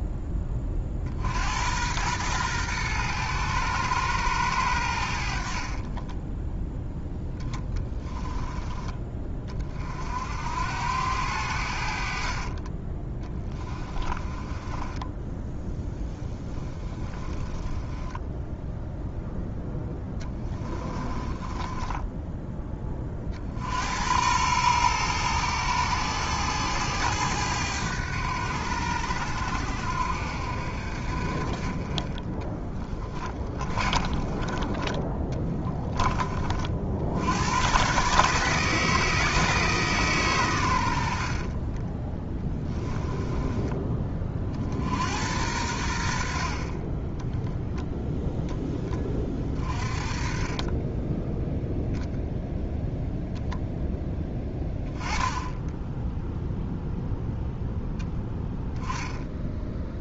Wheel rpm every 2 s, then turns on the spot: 40, 110, 80, 0, 20, 80, 30, 20, 10, 0, 20, 20, 110, 100, 80, 60, 30, 30, 60, 160, 80, 10, 70, 20, 20, 10, 0, 10, 0, 10.
12-18 20-22 32-34 42-44 46-48